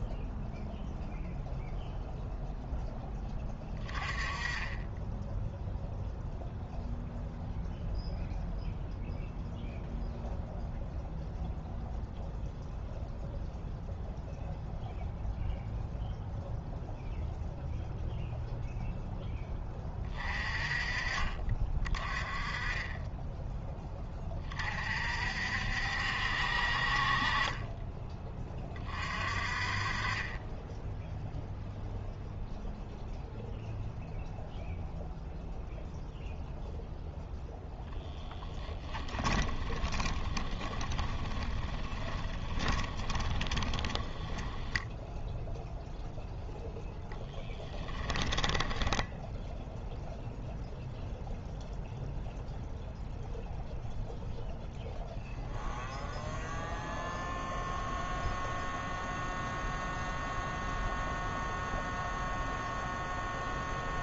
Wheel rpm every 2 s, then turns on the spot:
0, 0, 20, 0, 0, 0, 0, 0, 0, 0, 30, 20, 40, 50, 30, 10, 0, 0, 0, 10, 20, 20, 10, 0, 10, 0, 0, 0, 0, 0, 0, 0.
38-44 48-50